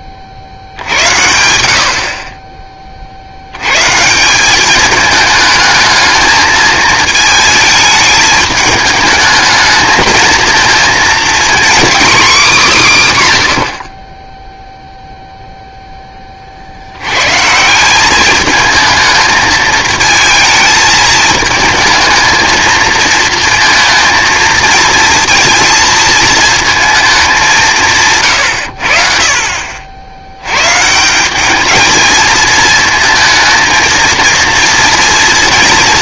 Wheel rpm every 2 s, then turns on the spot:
70, 40, 210, 220, 220, 230, 190, 0, 70, 220, 220, 230, 230, 220, 70, 150, 220, 230.
none